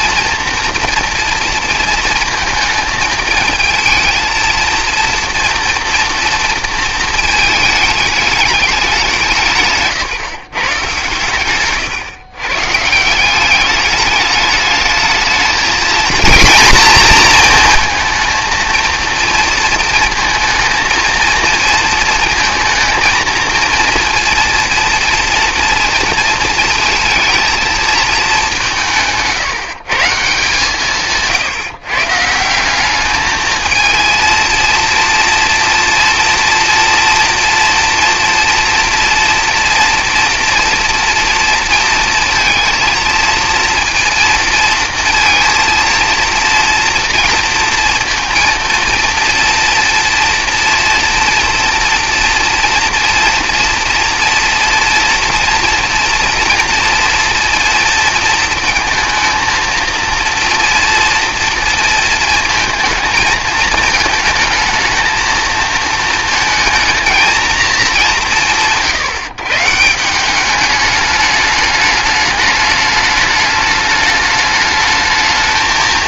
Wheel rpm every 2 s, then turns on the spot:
240, 220, 230, 230, 200, 150, 140, 210, 240, 230, 230, 230, 230, 230, 200, 150, 180, 230, 230, 230, 230, 220, 230, 230, 230, 240, 230, 230, 230, 230, 230, 220, 220, 230, 120, 200, 210, 210.
none